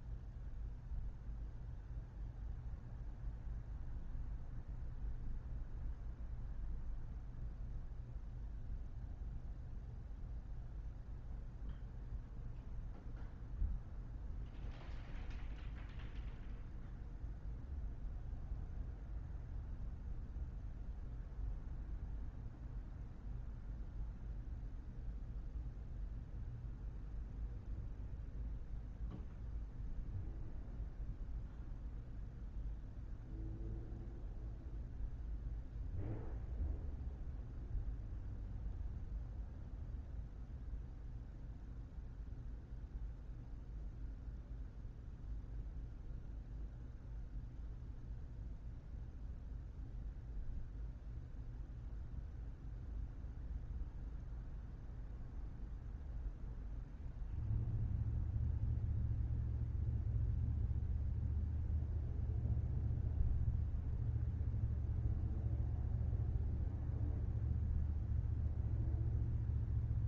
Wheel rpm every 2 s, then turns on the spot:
0, 0, 0, 0, 0, 0, 0, 0, 0, 0, 0, 0, 0, 0, 0, 0, 0, 0, 0, 0, 0, 0, 0, 0, 0, 0, 0, 0, 0, 0, 0, 0, 0, 0, 0.
none